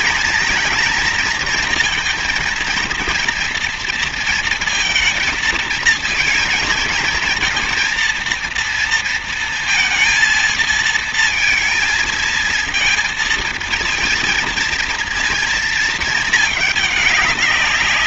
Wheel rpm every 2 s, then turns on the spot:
230, 230, 230, 220, 230, 220, 230, 230, 210.
none